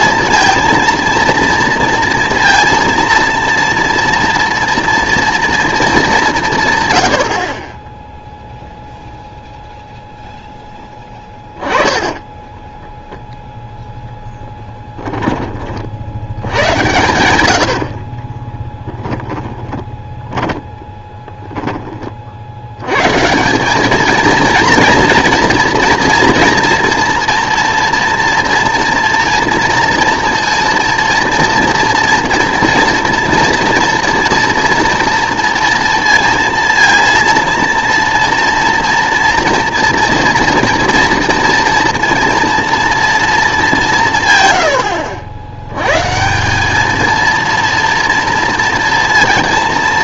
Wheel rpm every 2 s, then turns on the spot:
230, 230, 230, 160, 0, 10, 10, 10, 90, 20, 10, 70, 230, 230, 230, 230, 230, 230, 230, 230, 230, 230, 120, 190, 230.
12-16 18-22